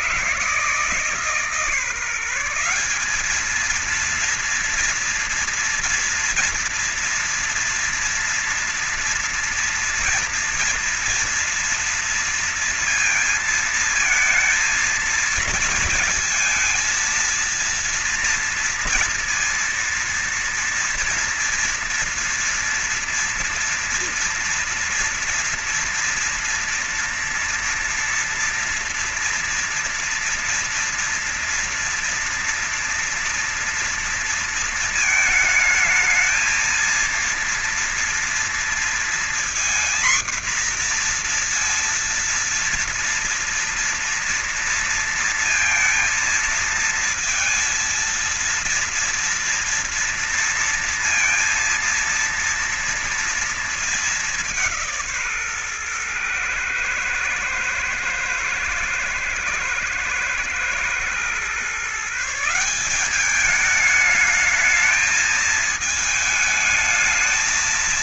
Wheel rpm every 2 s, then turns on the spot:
150, 180, 230, 230, 230, 230, 230, 230, 220, 230, 230, 230, 230, 230, 230, 230, 240, 230, 230, 230, 240, 230, 230, 230, 230, 230, 230, 190, 120, 110, 110, 160, 220, 220.
none